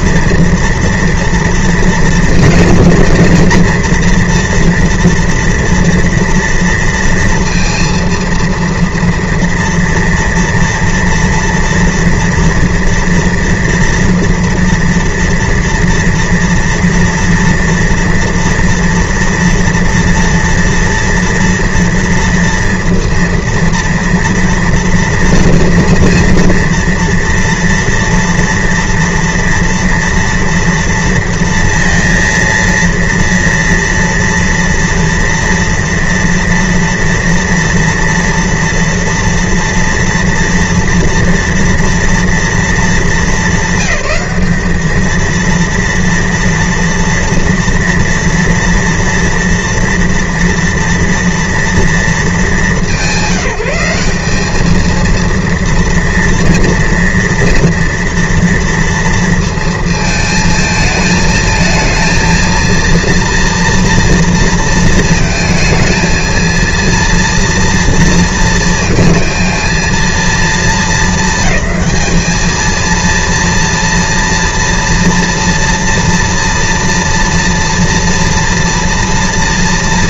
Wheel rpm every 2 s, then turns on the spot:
230, 230, 230, 230, 230, 230, 230, 230, 230, 230, 240, 230, 230, 230, 230, 230, 230, 230, 230, 230, 230, 210, 210, 230, 230, 230, 200, 220, 240, 230, 220, 230, 230, 230, 230, 220, 230, 230, 230, 230.
none